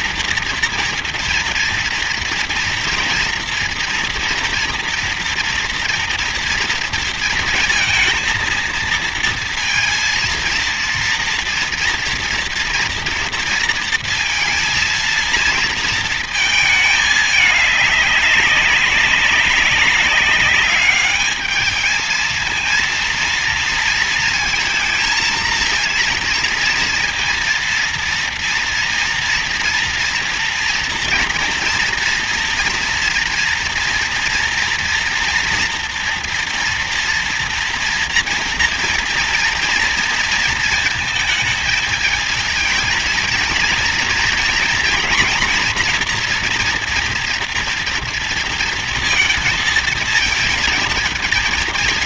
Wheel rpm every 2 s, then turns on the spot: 230, 230, 240, 230, 220, 230, 230, 230, 220, 200, 200, 220, 230, 230, 230, 240, 230, 240, 240, 230, 230, 220, 230, 230, 230, 220.
none